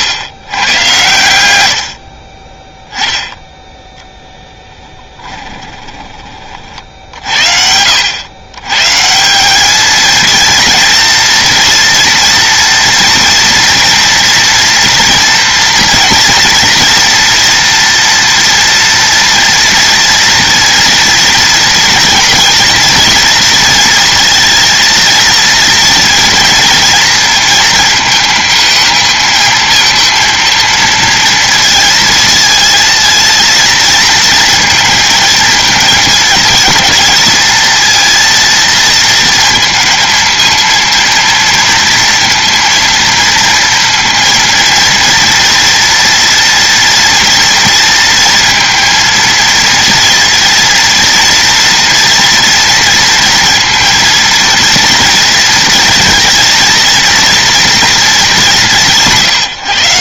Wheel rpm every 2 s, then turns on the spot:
110, 10, 10, 50, 140, 230, 230, 230, 230, 240, 230, 230, 230, 230, 220, 230, 220, 230, 220, 230, 230, 230, 230, 230, 230, 230, 230, 230, 230, 170.
4-6